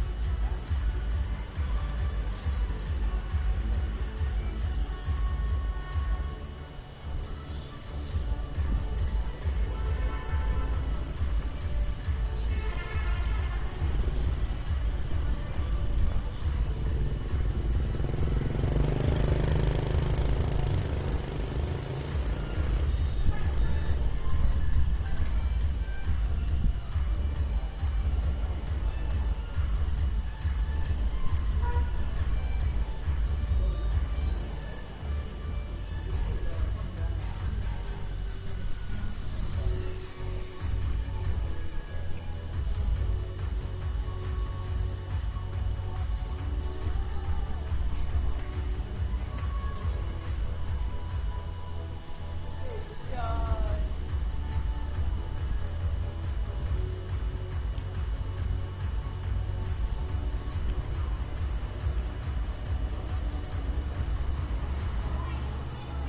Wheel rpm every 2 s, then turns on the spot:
0, 0, 0, 0, 0, 0, 0, 0, 0, 0, 0, 0, 0, 0, 0, 0, 0, 0, 0, 0, 0, 0, 0, 0, 0, 0, 0, 0, 0, 0, 0, 0, 0.
none